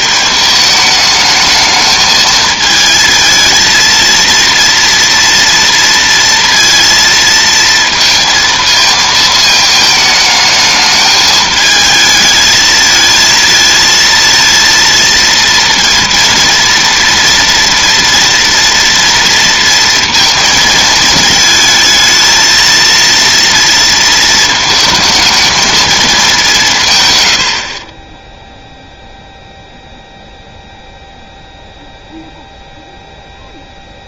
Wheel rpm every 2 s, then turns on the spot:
210, 220, 230, 230, 230, 220, 220, 230, 230, 230, 230, 230, 220, 170, 0, 0, 0.
none